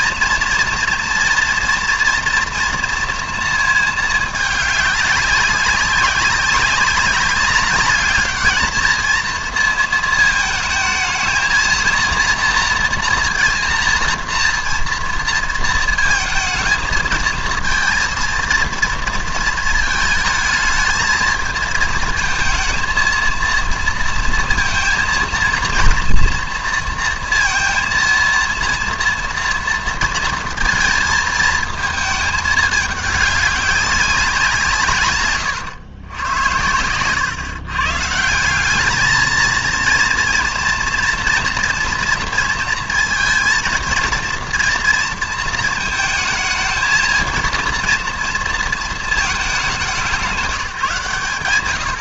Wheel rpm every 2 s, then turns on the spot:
240, 230, 210, 200, 220, 220, 230, 230, 220, 230, 220, 230, 230, 230, 230, 230, 210, 170, 100, 190, 230, 230, 230, 220, 230, 160.
none